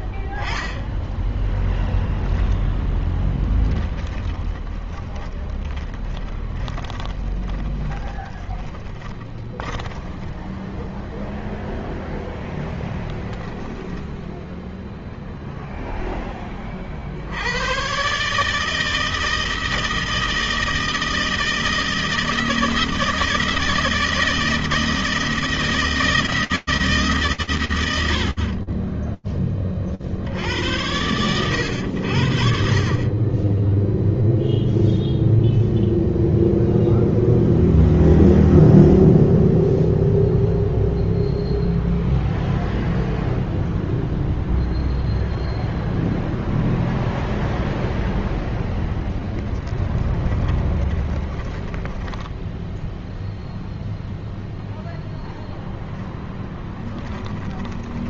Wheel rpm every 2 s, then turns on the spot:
0, 20, 20, 20, 20, 0, 0, 0, 80, 160, 160, 160, 160, 80, 20, 100, 10, 0, 0, 0, 0, 0, 0, 0, 20, 20, 0, 0, 20.
2-10 48-52 56-58